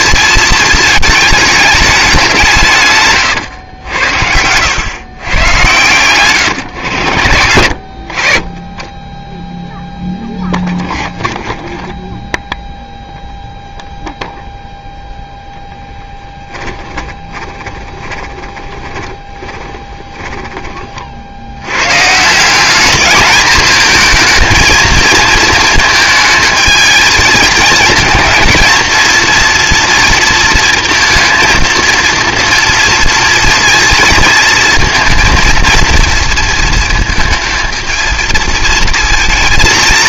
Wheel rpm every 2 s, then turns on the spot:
220, 150, 110, 110, 20, 20, 0, 0, 10, 20, 20, 190, 230, 220, 230, 230, 230, 220, 230, 230.
10-12 16-20